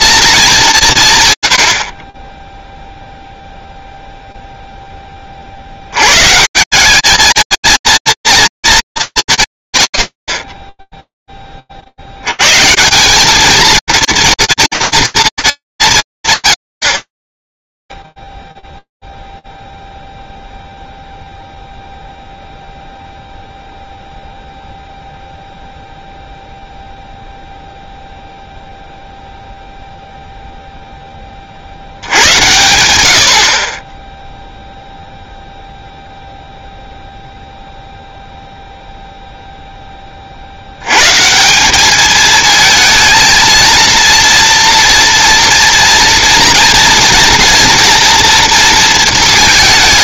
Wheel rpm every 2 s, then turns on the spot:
180, 0, 30, 210, 230, 50, 110, 230, 150, 0, 0, 0, 0, 0, 0, 50, 40, 0, 0, 20, 210, 230, 230, 230, 220.
none